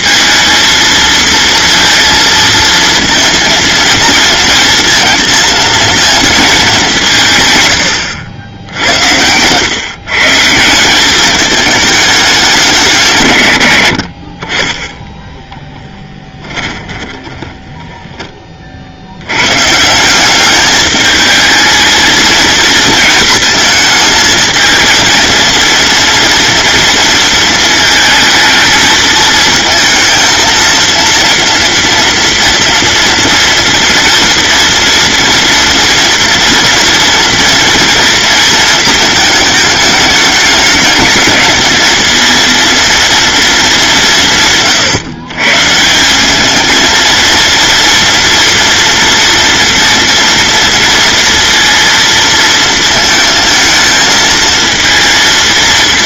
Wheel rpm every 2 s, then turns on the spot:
230, 230, 230, 200, 90, 170, 190, 40, 20, 40, 200, 230, 220, 230, 220, 230, 230, 240, 240, 230, 210, 230, 150, 220, 230, 230, 230, 230.
16-18